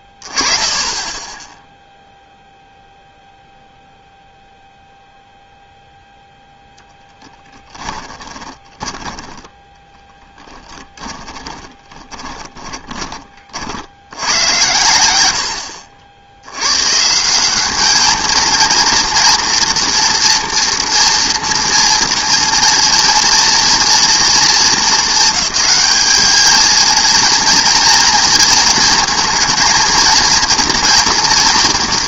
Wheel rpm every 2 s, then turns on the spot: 0, 0, 0, 20, 10, 20, 90, 60, 220, 240, 230, 230, 220, 230, 230, 230.
6-12